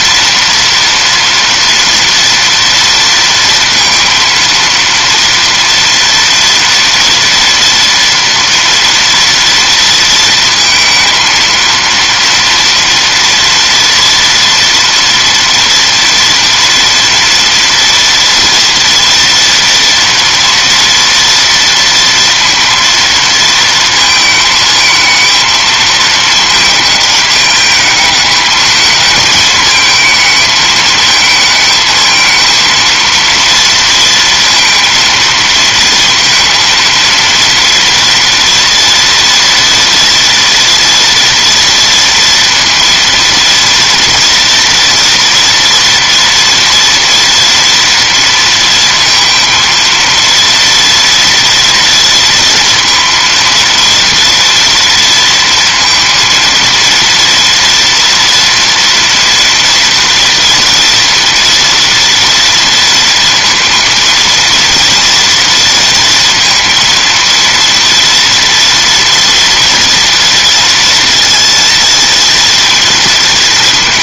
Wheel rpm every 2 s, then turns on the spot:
230, 230, 230, 230, 230, 230, 230, 240, 240, 230, 230, 230, 220, 210, 210, 220, 230, 230, 230, 240, 230, 230, 230, 230, 230, 230, 230, 230, 230, 230, 230, 230, 230, 230, 230, 230, 230.
none